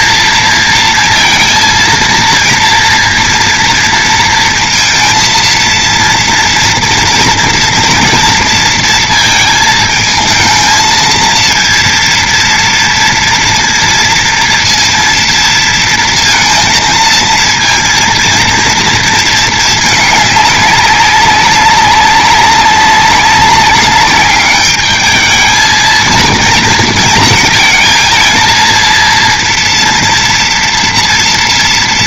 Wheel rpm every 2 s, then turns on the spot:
230, 230, 230, 230, 230, 220, 230, 230, 230, 230, 200, 190, 210, 230, 230, 230.
none